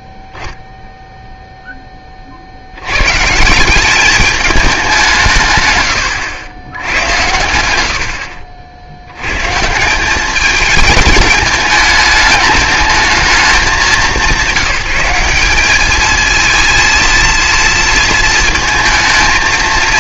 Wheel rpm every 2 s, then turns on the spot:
0, 80, 200, 100, 60, 210, 210, 190, 230, 230.
none